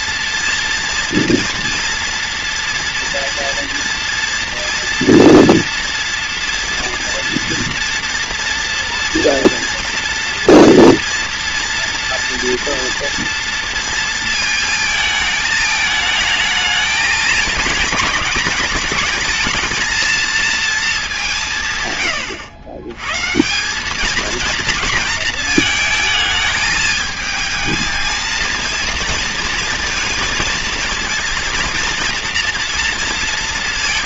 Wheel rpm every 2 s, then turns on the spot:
230, 230, 240, 230, 230, 230, 230, 220, 220, 210, 230, 100, 230, 220, 230, 230, 230.
none